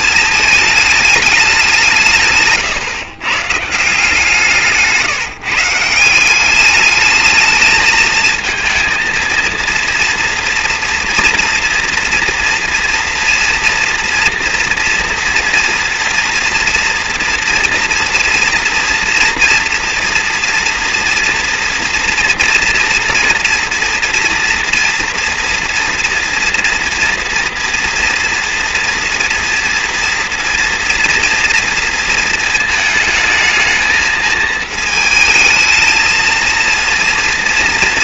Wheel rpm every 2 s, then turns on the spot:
210, 140, 160, 200, 230, 230, 230, 230, 230, 230, 240, 230, 230, 240, 230, 230, 220, 220, 230.
2-4